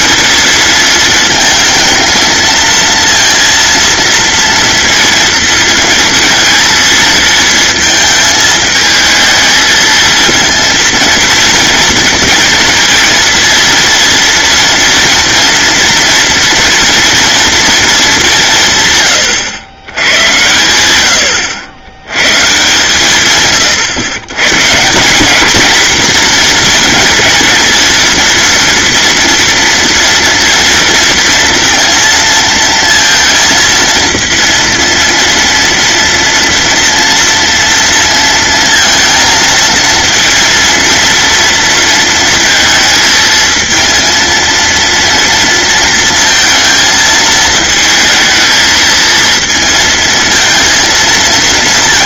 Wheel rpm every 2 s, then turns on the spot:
230, 220, 230, 230, 220, 230, 230, 230, 230, 140, 110, 140, 160, 230, 230, 230, 230, 230, 230, 230, 230, 220, 230, 220, 220, 230.
none